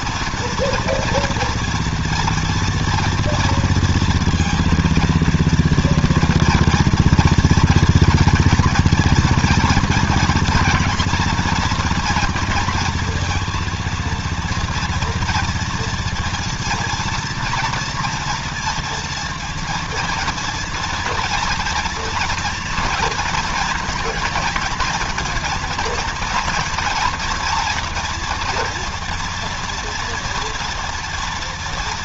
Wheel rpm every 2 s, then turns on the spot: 230, 230, 230, 230, 230, 230, 240, 230, 230, 230, 230, 230, 220, 230, 230, 230.
none